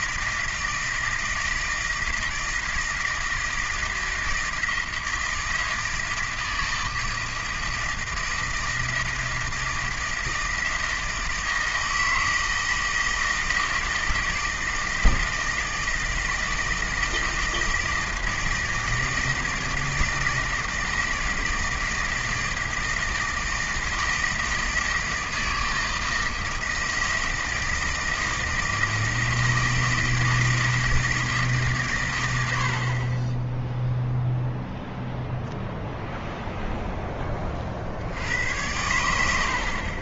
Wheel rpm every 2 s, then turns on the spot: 160, 160, 160, 160, 160, 160, 160, 160, 160, 160, 160, 160, 160, 160, 160, 160, 60, 0, 0, 90.
none